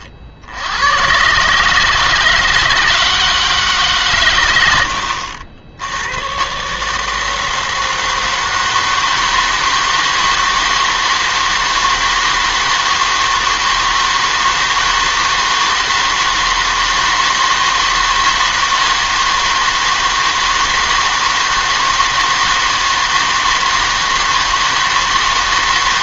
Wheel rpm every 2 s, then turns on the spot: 100, 160, 90, 140, 160, 160, 160, 160, 160, 160, 160, 160, 160.
none